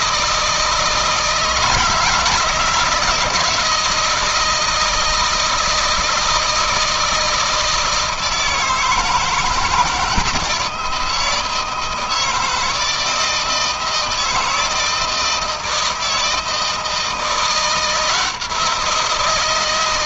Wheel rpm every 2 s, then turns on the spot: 160, 160, 160, 160, 160, 160, 160, 160, 160, 170.
none